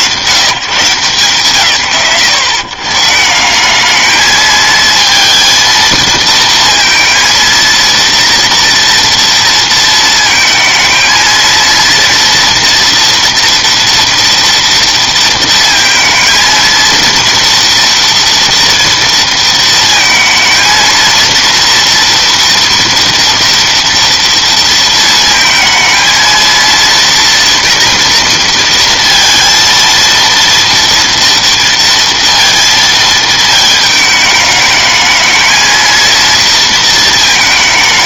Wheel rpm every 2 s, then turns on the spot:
100, 130, 220, 230, 230, 220, 230, 230, 230, 230, 230, 230, 230, 230, 230, 230, 220, 210, 220.
none